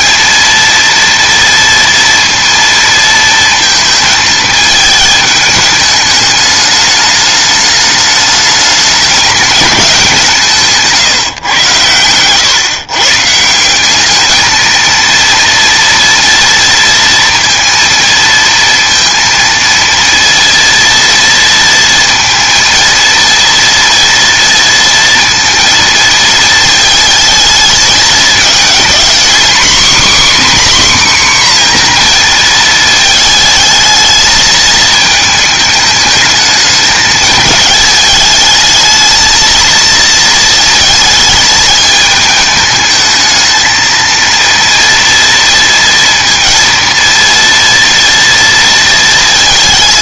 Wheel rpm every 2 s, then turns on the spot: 230, 230, 220, 210, 210, 160, 130, 220, 230, 230, 230, 230, 230, 220, 230, 280, 220, 220, 210, 220, 230, 220, 230, 230, 230.
none